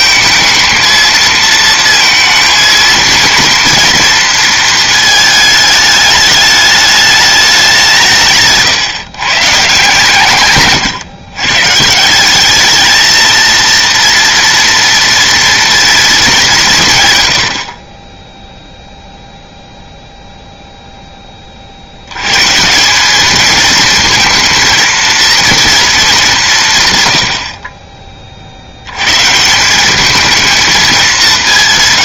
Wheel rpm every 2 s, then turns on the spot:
230, 230, 230, 210, 160, 140, 210, 230, 150, 0, 0, 170, 230, 140, 70, 220.
none